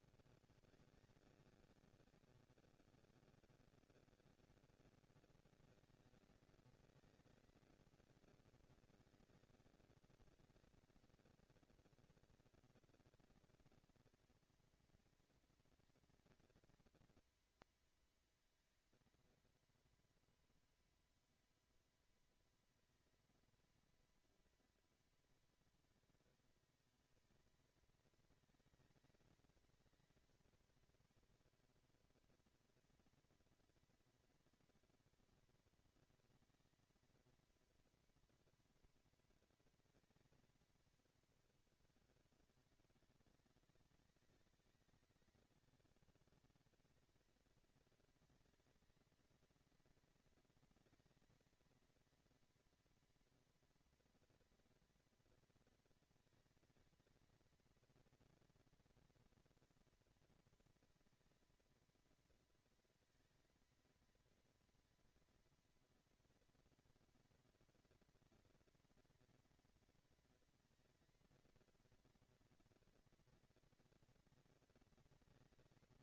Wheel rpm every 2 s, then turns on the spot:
190, 210, 230, 220, 230, 220, 230, 230, 230, 220, 230, 230, 230, 220, 220, 220, 220, 230, 230, 230, 220, 200, 200, 210, 230, 230, 230, 240, 220, 230, 230, 230, 230, 230, 230, 230, 230, 230.
none